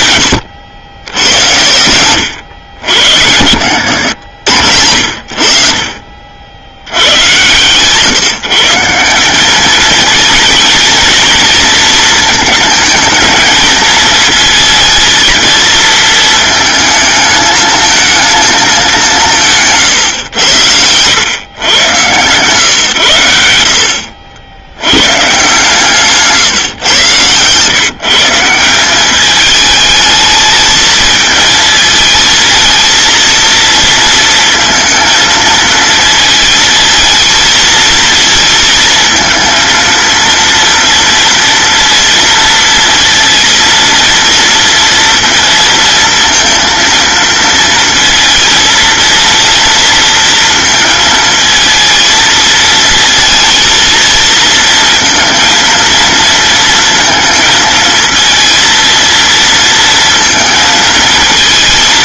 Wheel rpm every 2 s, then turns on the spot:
100, 100, 80, 60, 160, 220, 220, 220, 220, 220, 100, 130, 90, 140, 170, 220, 220, 230, 220, 220, 230, 230, 230, 230, 230, 230, 230, 230, 230, 230, 230.
none